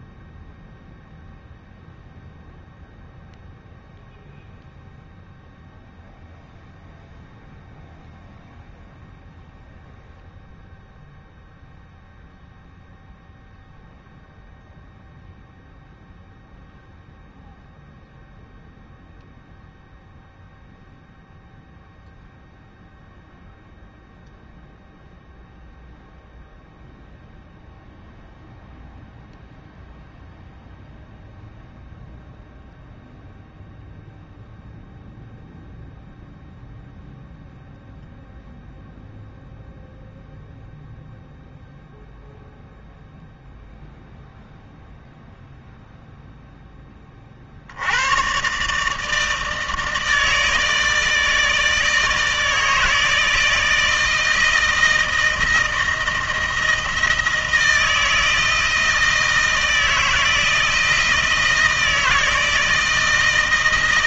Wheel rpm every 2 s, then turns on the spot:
0, 0, 0, 0, 0, 0, 0, 0, 0, 0, 0, 0, 0, 0, 0, 0, 0, 0, 0, 0, 0, 0, 0, 10, 130, 160, 160, 160, 160, 160, 160, 160.
none